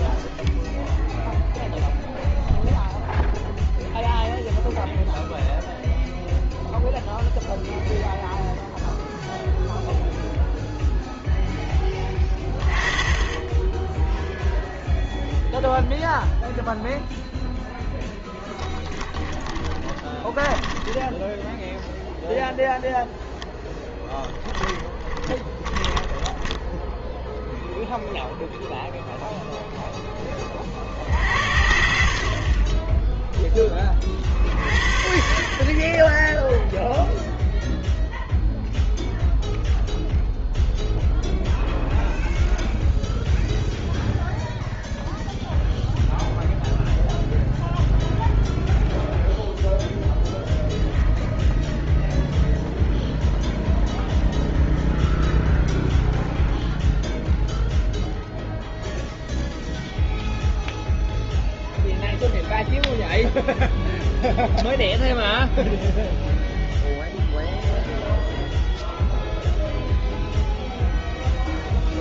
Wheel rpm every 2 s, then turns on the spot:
0, 0, 0, 0, 0, 0, 20, 0, 0, 10, 10, 0, 30, 10, 0, 20, 30, 50, 0, 0, 0, 0, 0, 0, 0, 0, 0, 0, 0, 0, 0, 0, 0, 0, 0, 0.
12-14 18-22 24-28